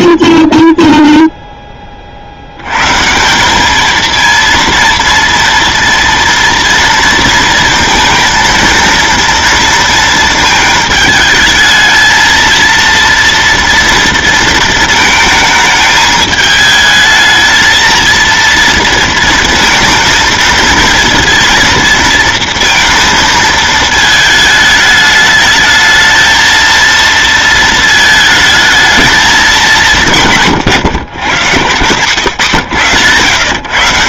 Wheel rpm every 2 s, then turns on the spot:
0, 110, 230, 230, 230, 220, 230, 230, 220, 230, 230, 230, 220, 230, 220, 140, 130.
none